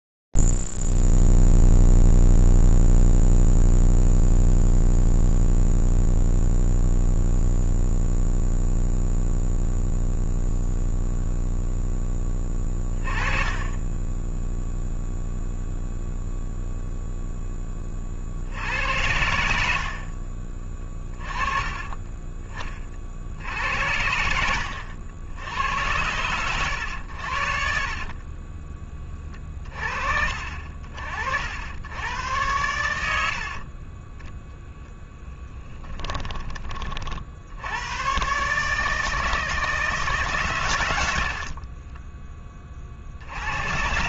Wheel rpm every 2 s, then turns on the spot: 0, 0, 0, 0, 0, 0, 10, 10, 0, 70, 40, 30, 80, 110, 20, 50, 100, 0, 30, 150, 120, 30.
20-22 28-30